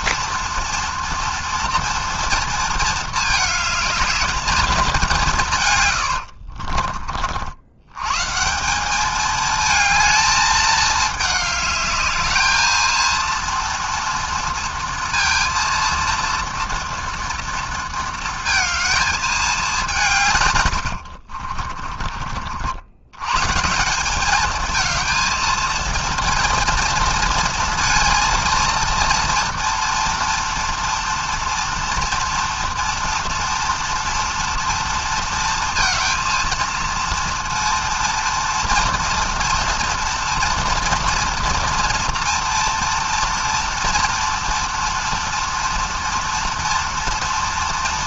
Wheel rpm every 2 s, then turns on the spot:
240, 220, 180, 50, 210, 210, 230, 230, 230, 220, 50, 120, 220, 230, 230, 230, 230, 230, 230, 230, 230, 230, 230, 230.
20-22